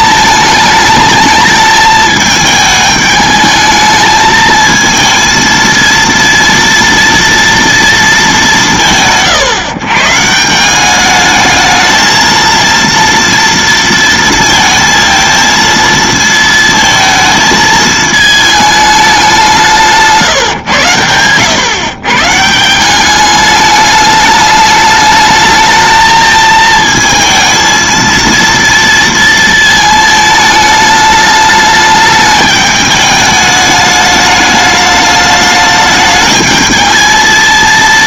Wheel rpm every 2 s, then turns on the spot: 220, 210, 220, 230, 110, 190, 230, 230, 220, 210, 120, 180, 210, 220, 230, 210, 210, 210, 220.
none